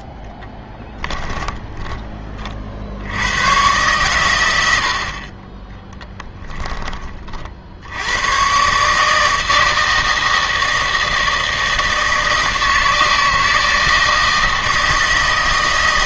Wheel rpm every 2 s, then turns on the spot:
10, 50, 100, 20, 130, 160, 160, 160.
0-2 6-8